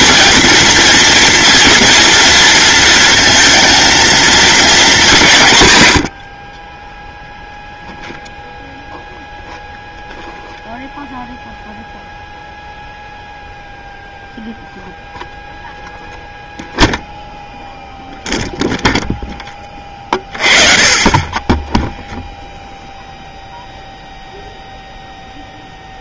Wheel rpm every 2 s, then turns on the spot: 230, 230, 210, 10, 0, 0, 0, 0, 0, 0, 30, 0, 0.
none